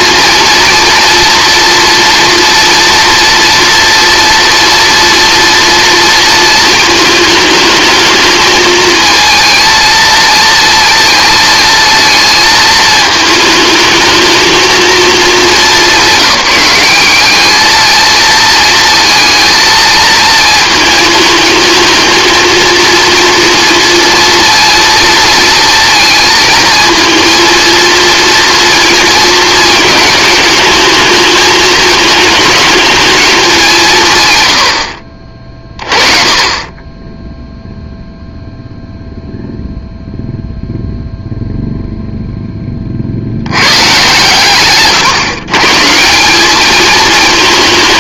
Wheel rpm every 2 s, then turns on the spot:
230, 240, 240, 220, 220, 230, 220, 220, 190, 230, 230, 230, 230, 230, 230, 220, 220, 90, 20, 0, 0, 20, 120, 210.
none